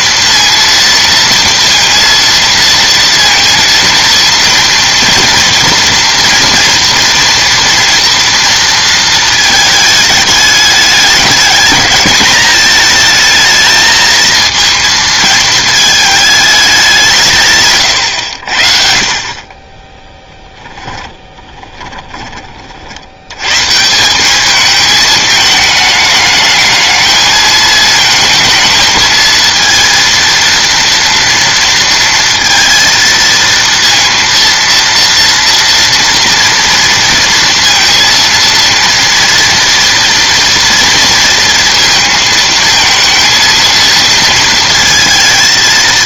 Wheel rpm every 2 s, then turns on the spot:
230, 230, 240, 230, 230, 210, 220, 220, 200, 60, 10, 50, 210, 210, 220, 230, 230, 230, 230, 230, 230, 220, 230.
20-22